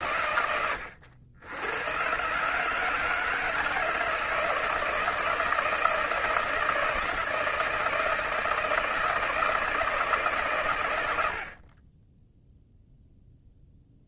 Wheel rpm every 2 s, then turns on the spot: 90, 160, 160, 160, 160, 110, 0.
none